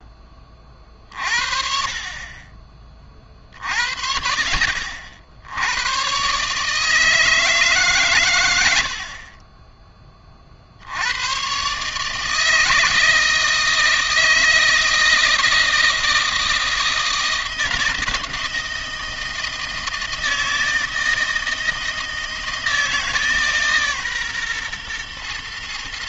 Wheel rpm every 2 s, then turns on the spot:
20, 30, 60, 140, 110, 40, 150, 160, 160, 160, 160, 170, 130.
none